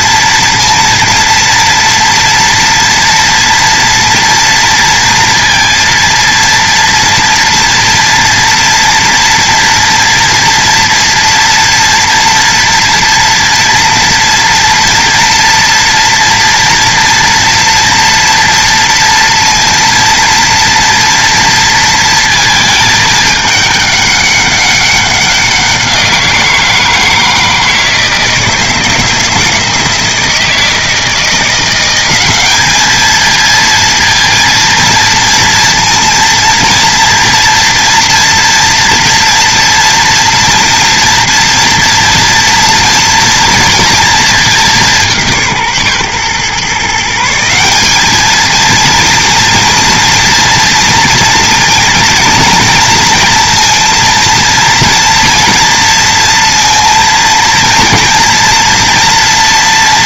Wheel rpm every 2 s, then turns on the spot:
230, 230, 230, 230, 230, 230, 230, 230, 230, 230, 230, 220, 200, 170, 160, 160, 210, 230, 230, 230, 230, 240, 190, 150, 230, 230, 230, 230, 230, 230.
none